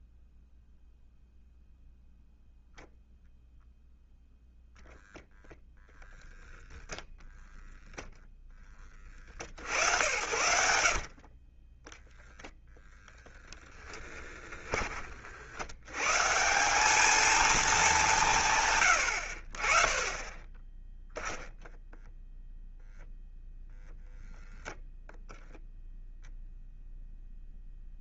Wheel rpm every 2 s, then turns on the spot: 0, 0, 10, 0, 30, 50, 0, 30, 200, 120, 10, 0, 0, 0.
10-12